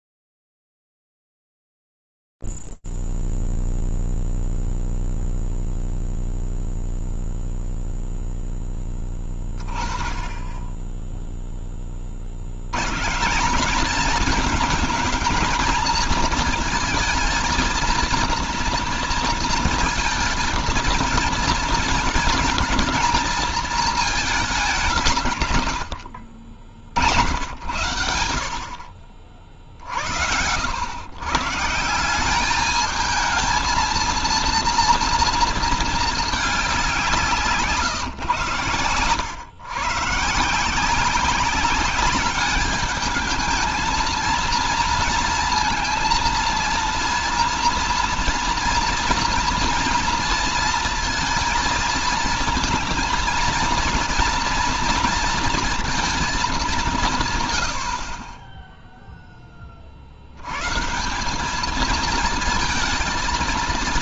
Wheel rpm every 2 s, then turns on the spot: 0, 0, 0, 0, 0, 10, 50, 210, 220, 230, 220, 220, 210, 70, 80, 90, 210, 230, 210, 130, 160, 210, 230, 230, 230, 230, 230, 230, 200, 10, 120, 220.
none